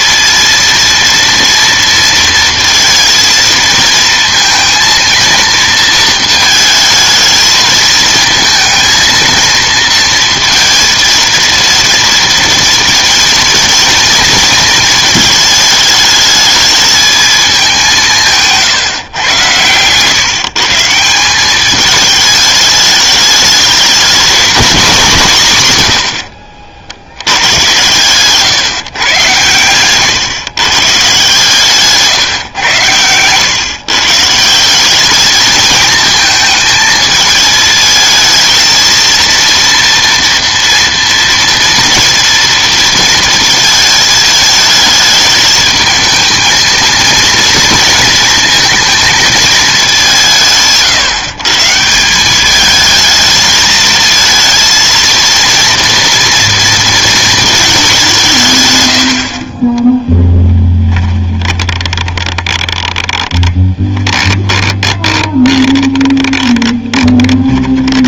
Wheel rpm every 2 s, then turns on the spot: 230, 230, 230, 220, 220, 230, 230, 220, 210, 150, 150, 210, 210, 80, 140, 140, 120, 180, 220, 220, 230, 230, 210, 230, 230, 150, 210, 230, 230, 130, 10, 30, 20, 20.
60-68